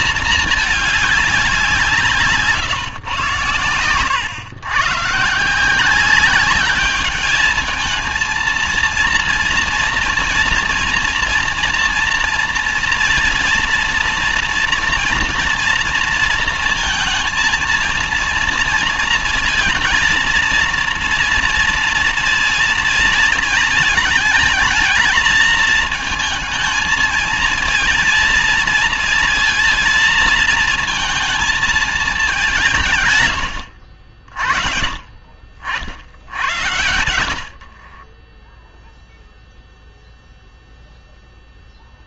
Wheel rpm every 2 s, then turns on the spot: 210, 140, 130, 200, 230, 230, 230, 230, 230, 230, 230, 230, 220, 220, 230, 230, 170, 40, 70, 0, 0.
none